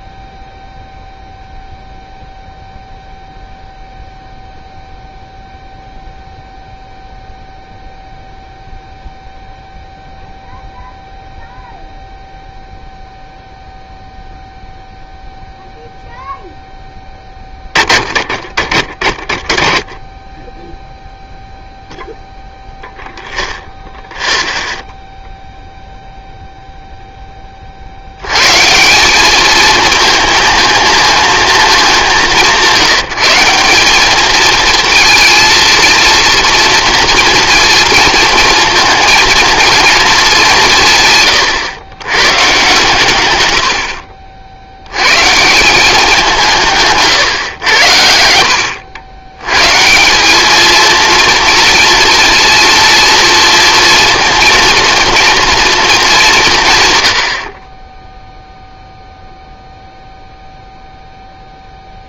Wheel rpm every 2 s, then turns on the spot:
0, 0, 0, 0, 0, 0, 0, 0, 10, 30, 0, 0, 0, 0, 170, 230, 180, 230, 230, 220, 170, 140, 80, 160, 80, 220, 230, 230, 150, 0, 0.
48-50